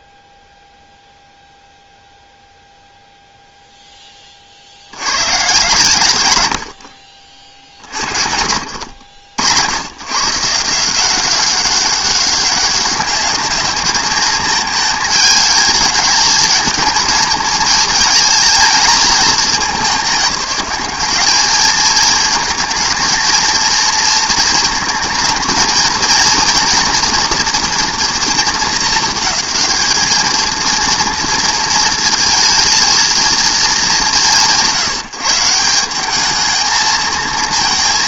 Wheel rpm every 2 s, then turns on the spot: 0, 100, 50, 60, 170, 200, 220, 220, 220, 200, 230, 230, 230, 220, 230, 220, 160, 220, 230.
4-6